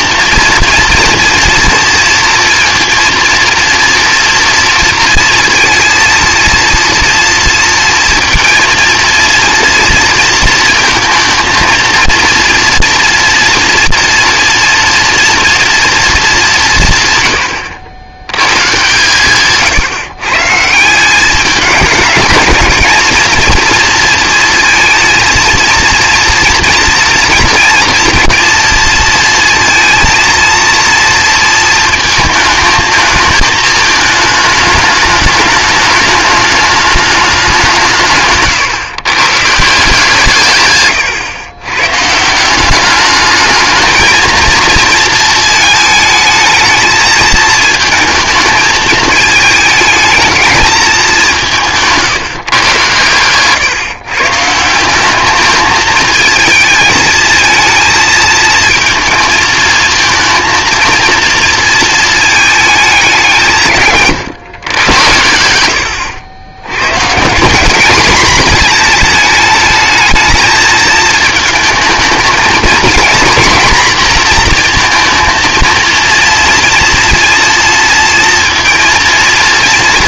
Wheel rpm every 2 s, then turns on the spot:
240, 230, 230, 230, 230, 230, 240, 230, 160, 150, 160, 220, 230, 230, 230, 230, 220, 220, 210, 140, 120, 190, 230, 220, 220, 220, 130, 170, 220, 230, 230, 210, 120, 110, 230, 220, 230, 230, 230, 230.
none